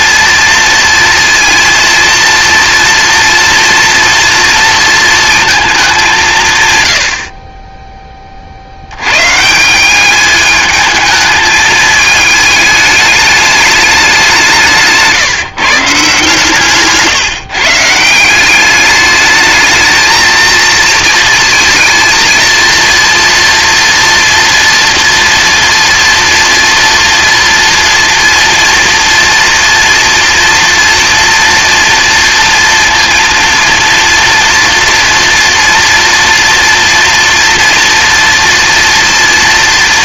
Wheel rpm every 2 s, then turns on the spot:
230, 230, 230, 100, 100, 210, 210, 160, 150, 200, 230, 230, 230, 230, 230, 230, 230, 230, 230, 230.
none